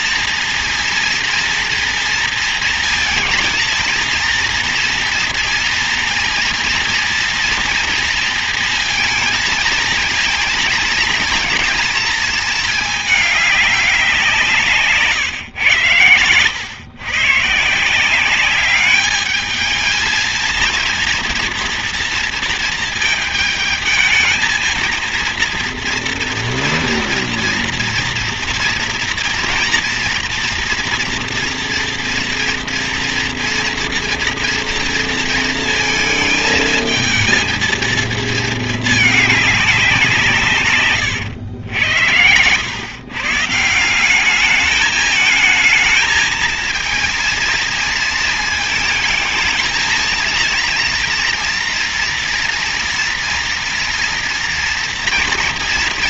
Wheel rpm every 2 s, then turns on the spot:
240, 230, 230, 230, 230, 220, 220, 160, 100, 200, 230, 230, 230, 230, 230, 230, 240, 230, 220, 220, 130, 110, 210, 230, 220, 230, 230, 230.
40-42